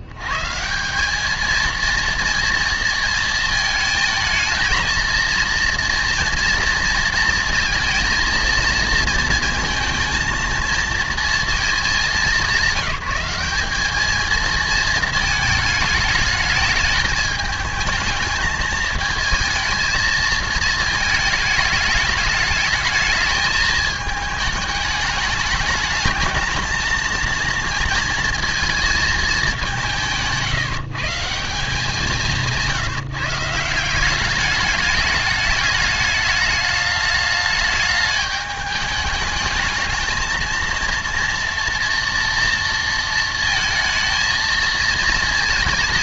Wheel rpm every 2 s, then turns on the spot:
130, 230, 230, 240, 230, 230, 210, 220, 220, 220, 220, 210, 210, 220, 230, 170, 180, 200, 210, 210, 220, 230, 230.
none